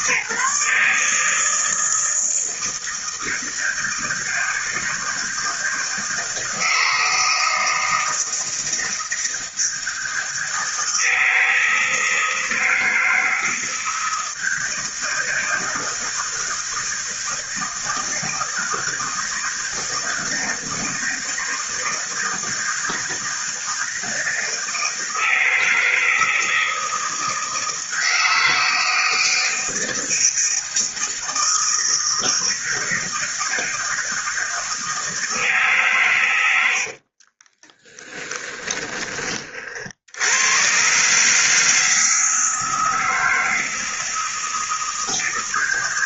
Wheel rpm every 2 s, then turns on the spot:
150, 160, 160, 160, 160, 160, 160, 160, 160, 160, 160, 160, 160, 160, 160, 160, 160, 160, 90, 20, 120, 160, 160.
36-40